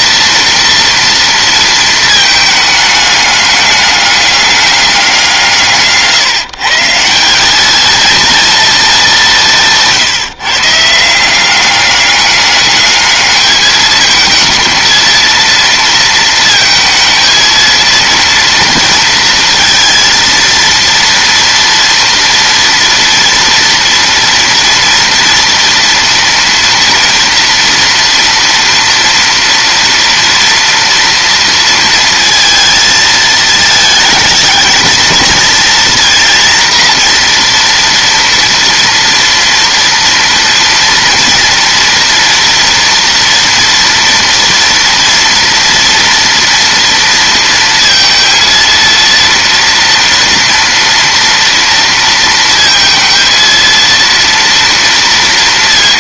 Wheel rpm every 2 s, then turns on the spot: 230, 210, 200, 150, 230, 150, 210, 230, 230, 230, 230, 230, 230, 240, 240, 230, 230, 220, 240, 230, 240, 240, 230, 230, 230, 230, 230, 230.
none